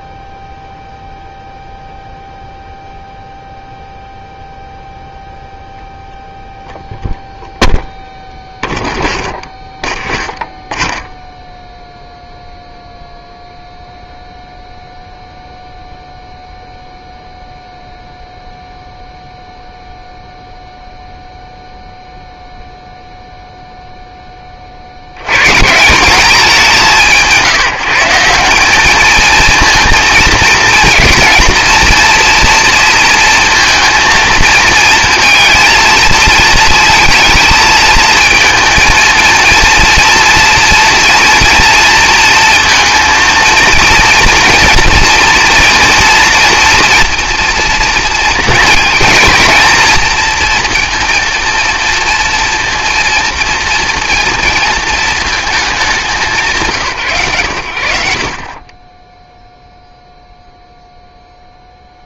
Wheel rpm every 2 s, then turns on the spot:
0, 0, 0, 0, 0, 0, 0, 0, 0, 0, 0, 0, 30, 190, 190, 230, 230, 220, 220, 220, 230, 230, 230, 230, 230, 230, 230, 230, 180, 40, 0.
none